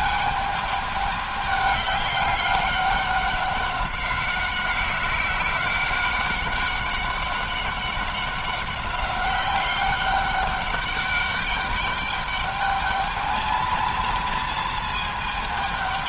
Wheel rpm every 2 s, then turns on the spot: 210, 200, 190, 200, 200, 200, 210, 220.
none